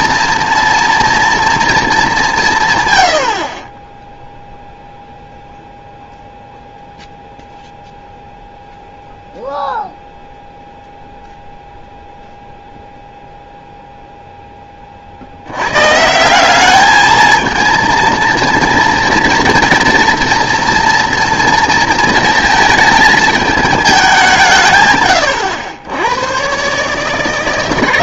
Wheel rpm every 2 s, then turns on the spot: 230, 140, 0, 0, 0, 0, 0, 20, 200, 230, 240, 220, 150, 130.
none